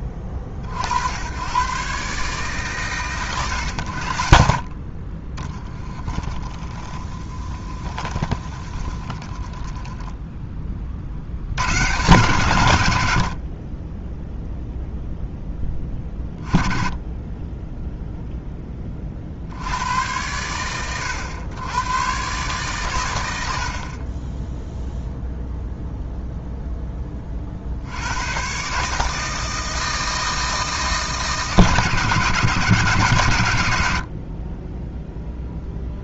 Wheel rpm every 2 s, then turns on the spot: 70, 130, 50, 20, 30, 30, 90, 0, 30, 20, 100, 120, 0, 10, 150, 160, 160, 10.
6-10